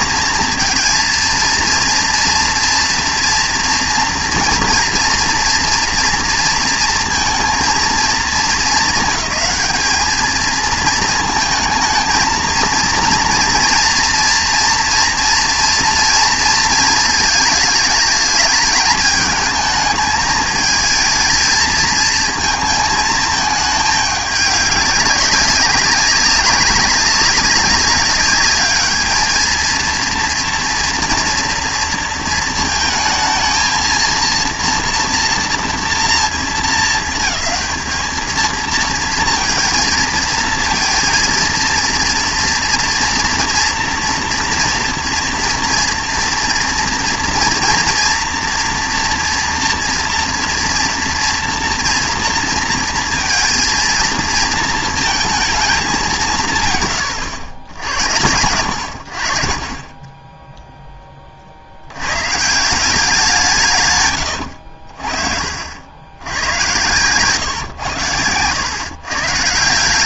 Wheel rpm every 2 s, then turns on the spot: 230, 230, 230, 230, 210, 220, 230, 230, 220, 210, 220, 220, 200, 190, 210, 230, 220, 230, 220, 230, 230, 240, 230, 230, 230, 230, 230, 230, 150, 90, 10, 170, 60, 110, 100.
64-66